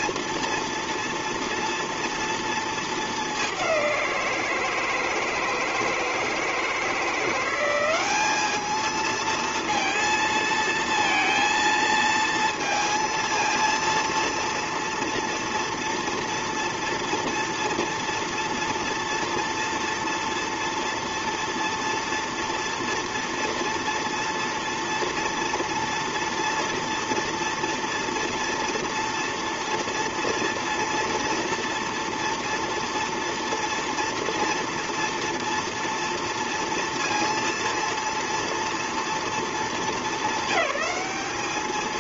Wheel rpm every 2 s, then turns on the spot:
230, 220, 160, 170, 220, 230, 230, 230, 230, 230, 230, 230, 230, 230, 230, 230, 230, 240, 230, 230, 200.
none